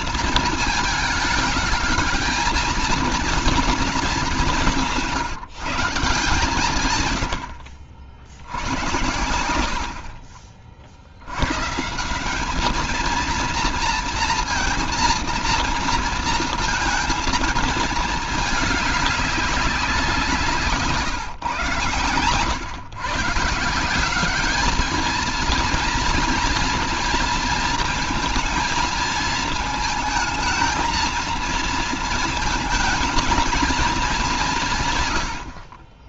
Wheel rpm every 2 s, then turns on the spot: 220, 230, 190, 160, 70, 50, 200, 230, 230, 220, 170, 110, 200, 230, 220, 220, 220, 190.
none